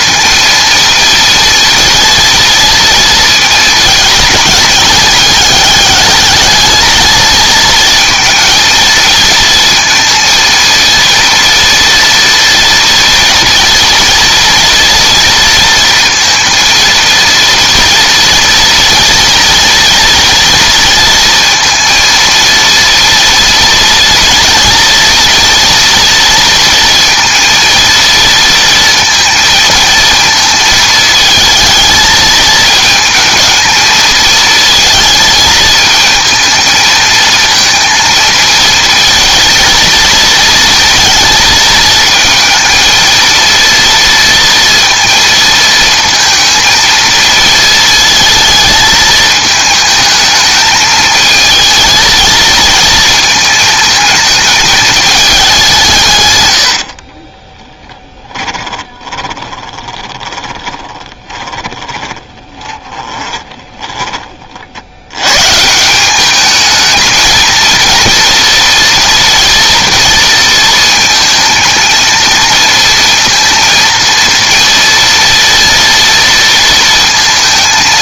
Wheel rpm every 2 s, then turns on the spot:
230, 230, 210, 220, 220, 230, 230, 230, 230, 230, 230, 230, 230, 230, 230, 220, 220, 220, 230, 230, 230, 230, 230, 230, 220, 220, 220, 220, 80, 20, 20, 20, 60, 220, 230, 230, 230, 230, 230.
58-64